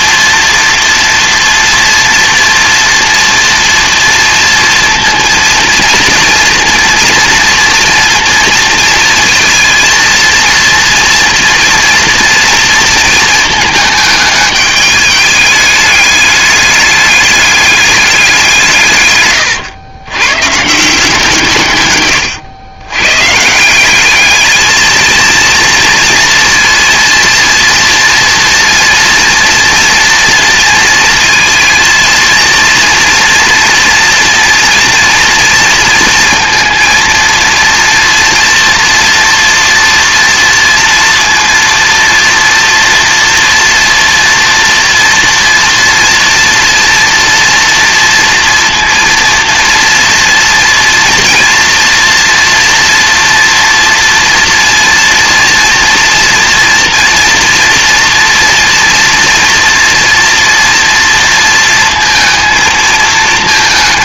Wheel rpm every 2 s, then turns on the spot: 230, 230, 230, 230, 230, 230, 230, 210, 210, 170, 150, 120, 220, 230, 230, 230, 230, 230, 230, 230, 230, 230, 230, 230, 230, 230, 230, 230, 230, 230, 230, 230.
none